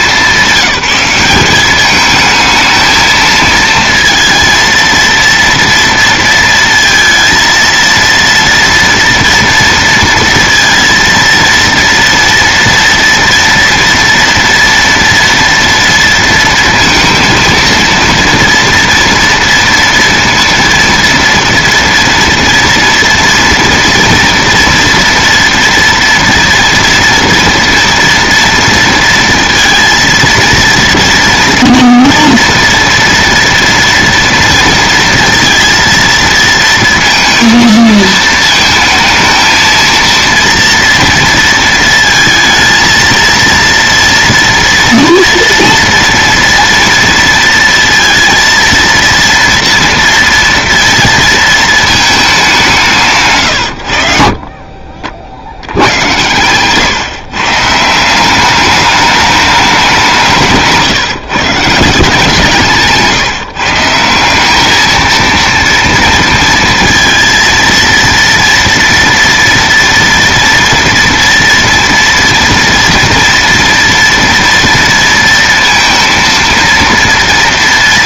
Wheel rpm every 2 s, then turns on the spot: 200, 220, 230, 230, 230, 230, 230, 230, 220, 230, 230, 230, 230, 230, 230, 230, 230, 230, 230, 220, 230, 230, 230, 230, 230, 230, 180, 50, 140, 210, 160, 160, 220, 230, 230, 240, 240, 230, 230.
none